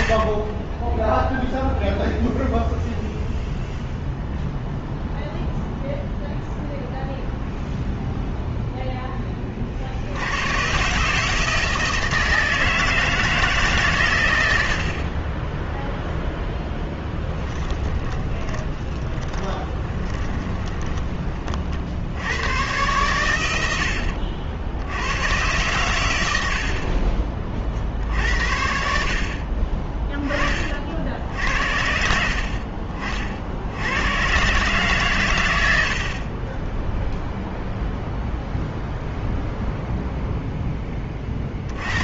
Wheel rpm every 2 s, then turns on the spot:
30, 0, 0, 0, 0, 110, 160, 90, 10, 20, 10, 110, 60, 70, 60, 40, 50, 140, 20, 0, 0.
18-22